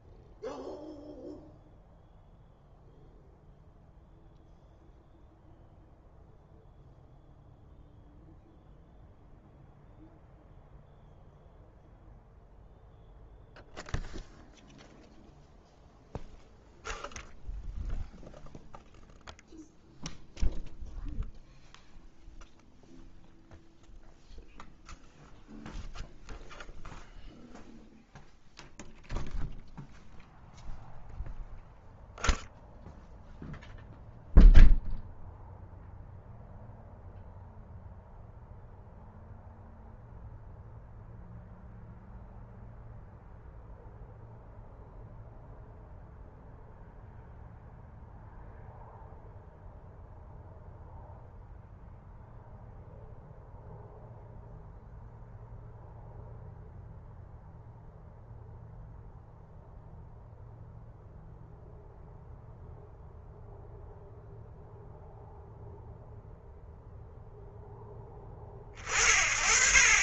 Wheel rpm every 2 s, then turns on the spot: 0, 0, 0, 0, 0, 0, 0, 0, 0, 0, 0, 0, 0, 0, 0, 0, 0, 0, 0, 0, 0, 0, 0, 0, 0, 0, 0, 0, 0, 0, 0, 0, 0, 0, 40.
none